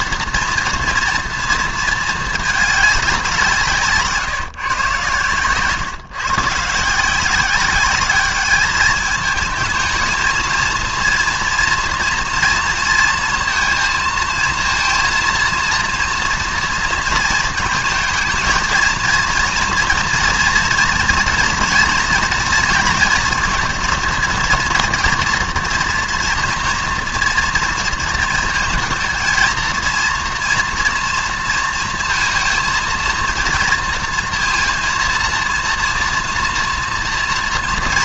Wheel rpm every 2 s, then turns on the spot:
240, 200, 130, 160, 210, 230, 230, 230, 230, 230, 230, 230, 230, 230, 220, 240, 230, 230, 230.
none